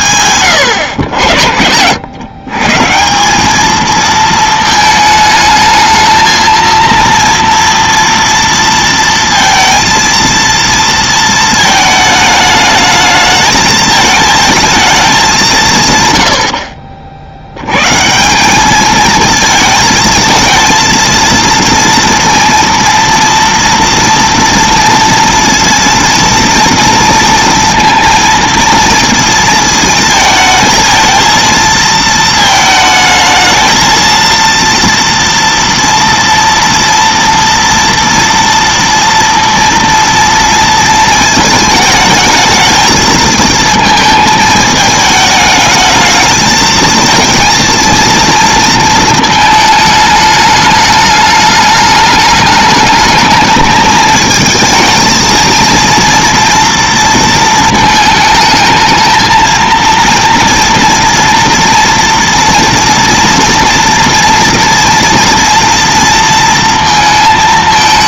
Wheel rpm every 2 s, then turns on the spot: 130, 140, 220, 230, 230, 230, 210, 220, 50, 200, 230, 230, 230, 230, 230, 220, 220, 230, 230, 230, 230, 220, 220, 220, 230, 210, 210, 220, 230, 220, 230, 230, 230, 230.
none